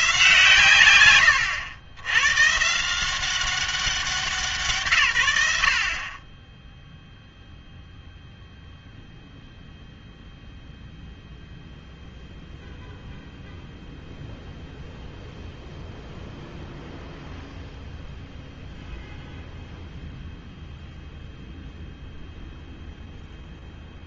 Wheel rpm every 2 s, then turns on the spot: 130, 150, 150, 0, 0, 0, 0, 0, 0, 0, 0, 0.
none